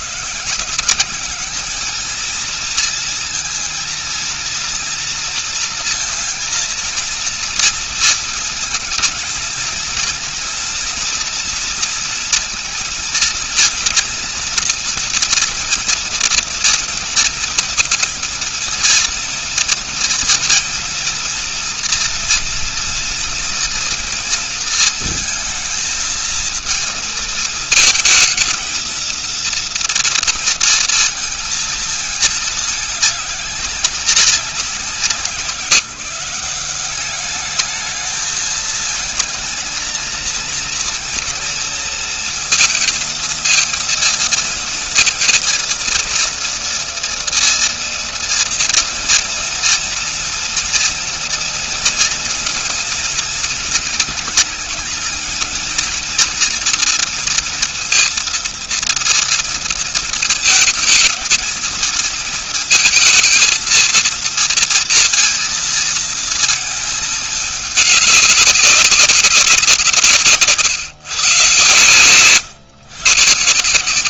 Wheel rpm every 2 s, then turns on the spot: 150, 220, 230, 230, 220, 230, 230, 230, 230, 230, 230, 230, 230, 230, 230, 230, 220, 180, 180, 220, 230, 230, 230, 230, 230, 230, 230, 220, 230, 230, 230, 230, 230, 220, 190, 140, 120.
none